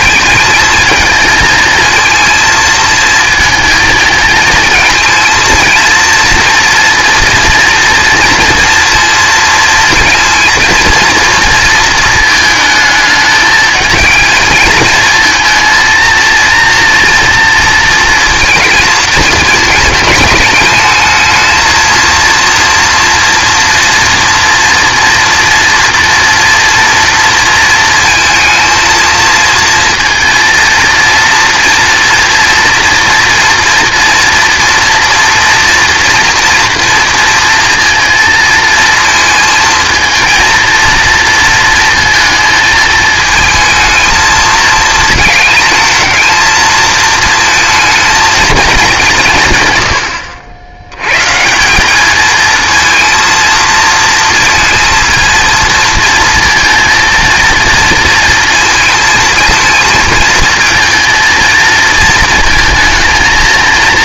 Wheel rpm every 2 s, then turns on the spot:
220, 220, 220, 230, 230, 230, 220, 220, 230, 220, 220, 230, 230, 230, 220, 230, 230, 230, 230, 230, 230, 220, 220, 230, 200, 90, 230, 220, 230, 230, 220, 230.
none